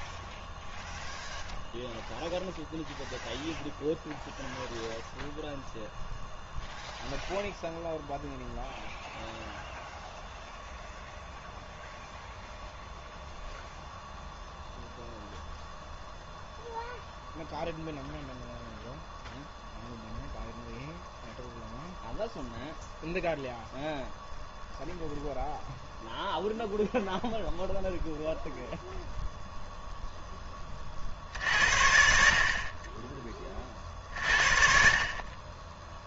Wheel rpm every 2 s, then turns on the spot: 0, 0, 0, 0, 0, 0, 0, 0, 0, 0, 0, 0, 0, 0, 0, 30, 30, 50.
34-36